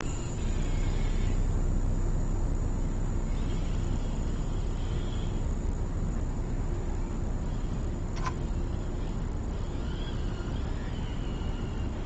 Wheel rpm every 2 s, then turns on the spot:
0, 0, 0, 0, 0, 0.
none